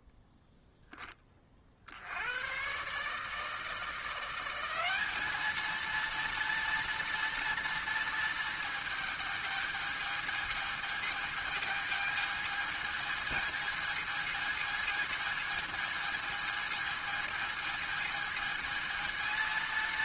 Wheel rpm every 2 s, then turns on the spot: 0, 120, 180, 230, 220, 220, 220, 220, 220, 220.
none